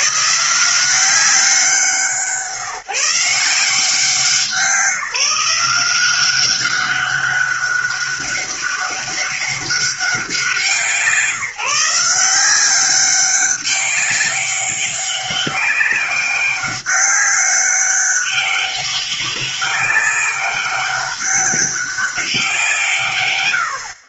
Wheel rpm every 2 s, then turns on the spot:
170, 150, 180, 190, 200, 180, 180, 200, 200, 200, 200, 170.
none